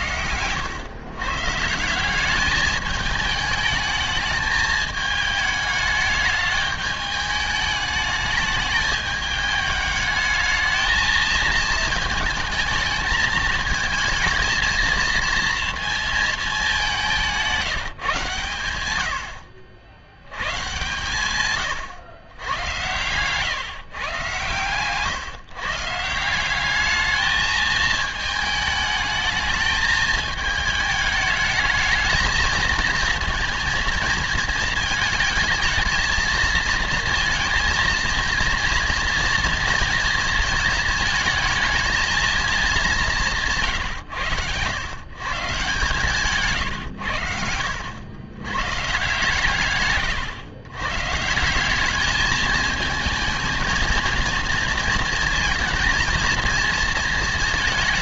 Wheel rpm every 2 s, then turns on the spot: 100, 210, 210, 210, 210, 220, 220, 230, 210, 110, 120, 100, 130, 190, 220, 220, 230, 220, 230, 230, 220, 210, 110, 130, 120, 100, 220, 230, 230.
none